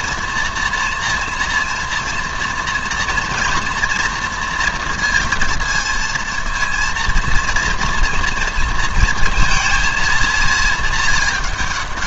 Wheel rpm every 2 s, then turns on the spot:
240, 230, 230, 230, 230, 220.
none